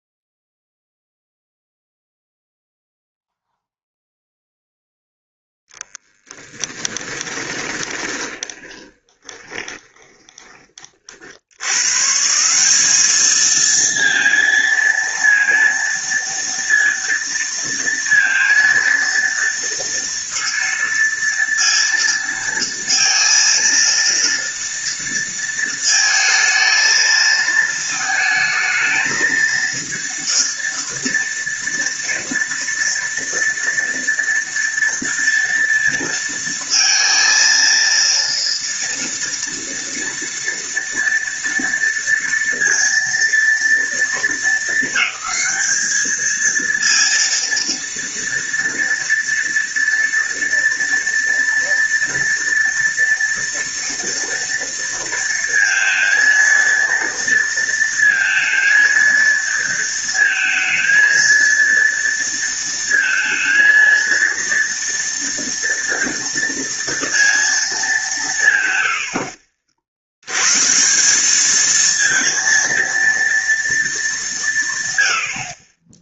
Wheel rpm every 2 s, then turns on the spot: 0, 0, 0, 10, 20, 30, 180, 230, 230, 230, 230, 230, 230, 220, 220, 230, 230, 230, 230, 230, 240, 230, 220, 230, 230, 230, 230, 230, 230, 230, 230, 230, 230, 230, 120, 140, 230, 140.
6-10